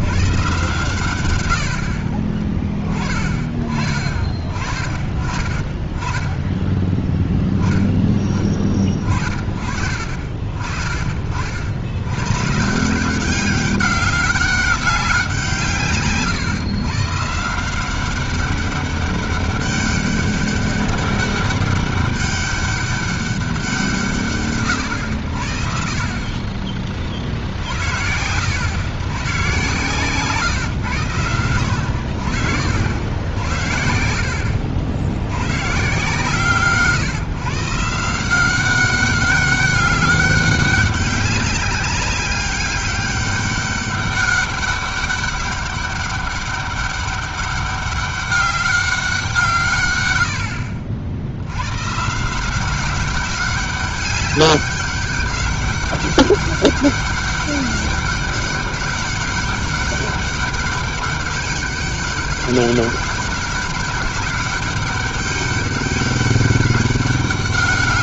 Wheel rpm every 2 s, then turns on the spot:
140, 30, 30, 20, 30, 40, 150, 200, 140, 200, 200, 200, 120, 30, 100, 130, 70, 80, 140, 190, 200, 200, 200, 200, 200, 70, 170, 200, 200, 200, 200, 200, 200, 200.
none